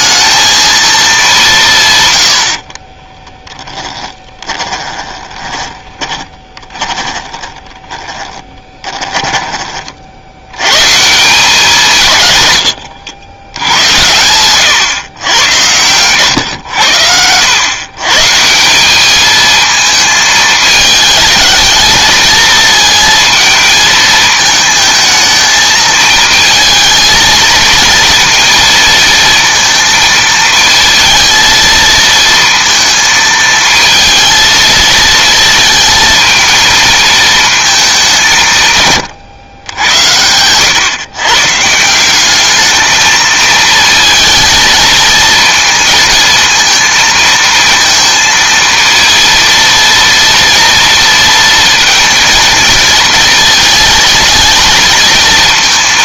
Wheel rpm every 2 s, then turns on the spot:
220, 60, 20, 20, 20, 90, 120, 110, 120, 160, 220, 220, 220, 220, 230, 230, 230, 220, 220, 160, 110, 210, 220, 220, 230, 230, 230, 230.
2-10